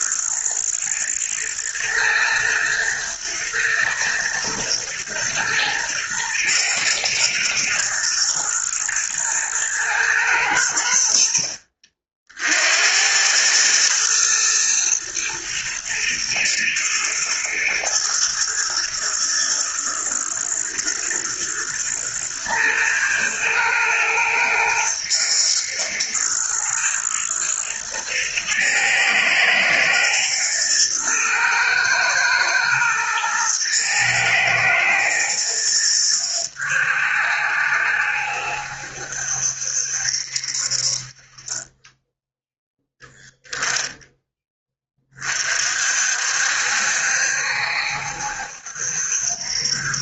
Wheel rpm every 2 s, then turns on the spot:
120, 120, 120, 110, 110, 100, 70, 110, 120, 110, 120, 110, 110, 120, 110, 120, 120, 110, 80, 70, 50, 0, 20, 70, 70.
none